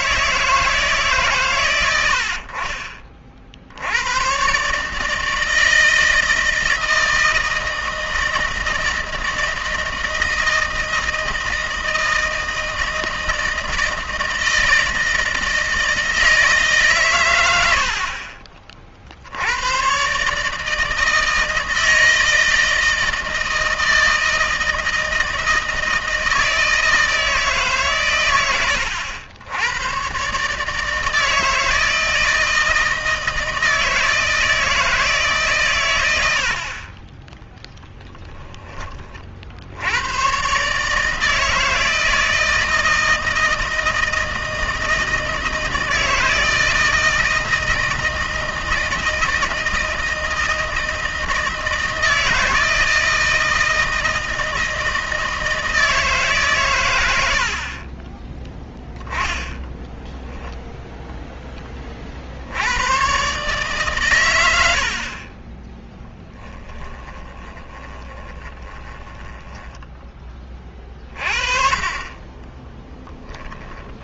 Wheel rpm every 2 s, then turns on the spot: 150, 50, 140, 160, 160, 160, 160, 160, 150, 50, 150, 160, 160, 160, 100, 140, 160, 160, 70, 20, 130, 160, 160, 160, 160, 160, 160, 160, 130, 20, 10, 60, 90, 10, 20, 20, 10.
66-70 72-74